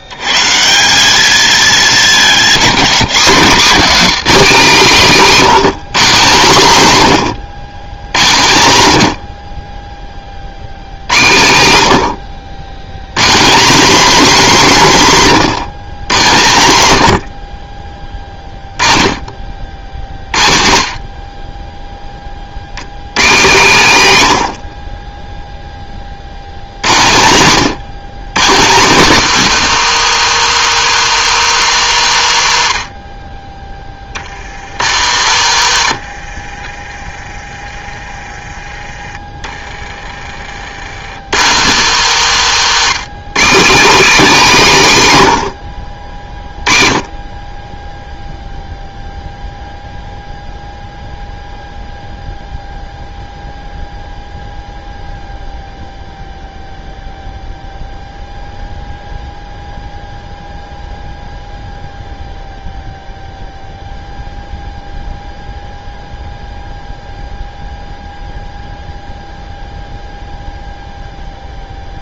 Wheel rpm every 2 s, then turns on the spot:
110, 200, 220, 190, 110, 60, 110, 240, 130, 30, 40, 120, 40, 110, 190, 170, 50, 90, 30, 20, 90, 170, 160, 30, 0, 0, 0, 0, 0, 0, 0, 0, 0, 0, 0, 0.
none